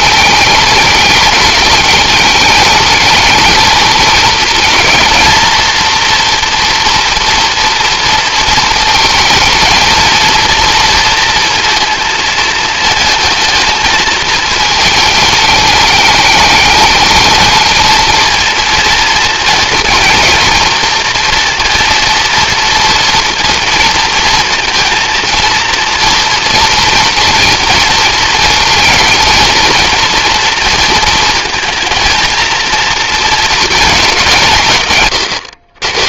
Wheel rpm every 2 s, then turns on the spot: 210, 210, 220, 230, 220, 230, 220, 220, 210, 230, 220, 230, 230, 240, 220, 230, 230, 150.
none